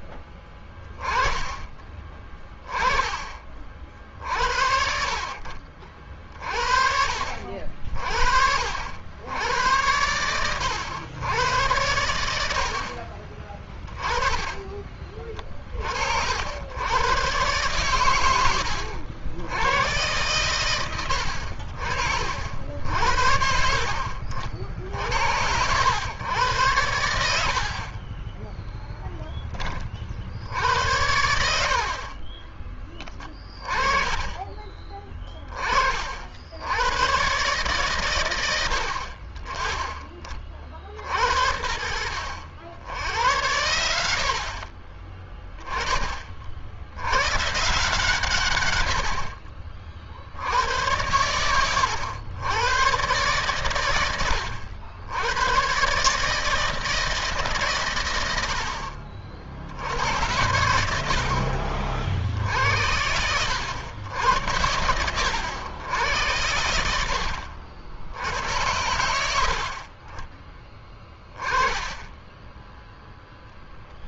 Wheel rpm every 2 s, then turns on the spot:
20, 20, 40, 60, 80, 100, 60, 30, 110, 90, 100, 70, 60, 100, 10, 80, 30, 20, 100, 80, 60, 90, 40, 80, 80, 100, 110, 90, 160, 60, 70, 70, 80, 80, 80, 20, 0.
32-34